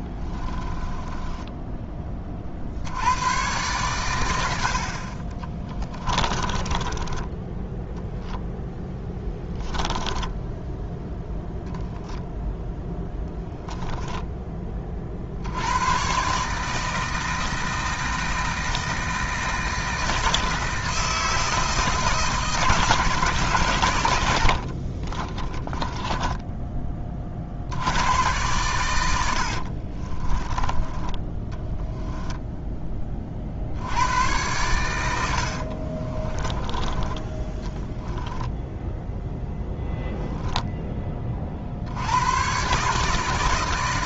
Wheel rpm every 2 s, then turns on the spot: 20, 70, 50, 20, 10, 10, 10, 30, 160, 160, 160, 160, 40, 20, 100, 20, 20, 100, 20, 0, 10, 140.
0-2 6-10 24-26 36-38